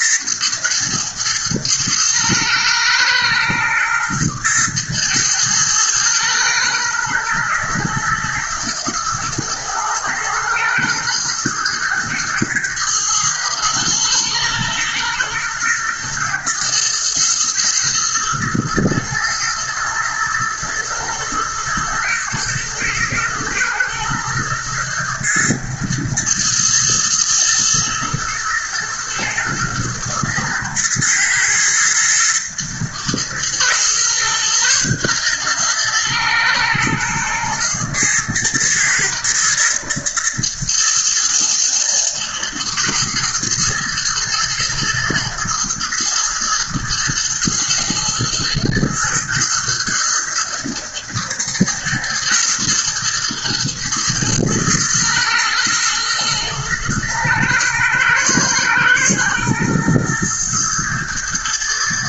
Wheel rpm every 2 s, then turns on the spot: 110, 110, 110, 120, 120, 110, 110, 110, 120, 110, 120, 110, 110, 110, 120, 110, 120, 120, 110, 110, 110, 120, 120, 110, 110, 110, 110, 110, 110, 120, 120.
none